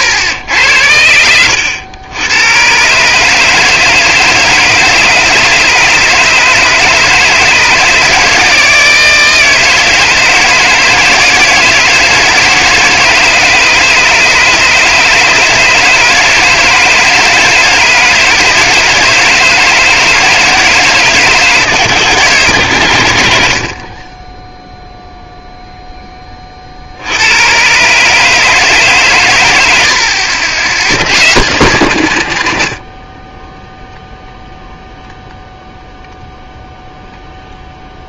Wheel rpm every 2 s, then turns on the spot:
90, 110, 160, 150, 160, 160, 160, 150, 160, 160, 160, 120, 10, 40, 150, 80, 80, 0, 0.
none